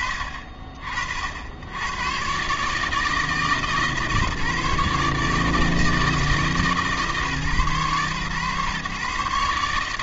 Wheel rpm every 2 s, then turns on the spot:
60, 150, 150, 150, 130.
none